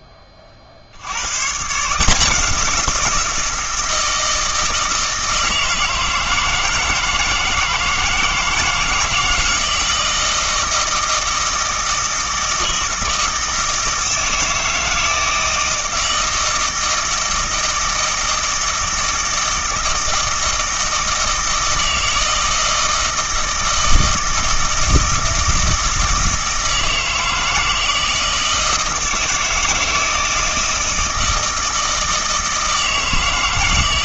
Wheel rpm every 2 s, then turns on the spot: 50, 170, 160, 160, 160, 160, 160, 160, 160, 160, 160, 160, 160, 160, 160, 160, 160.
none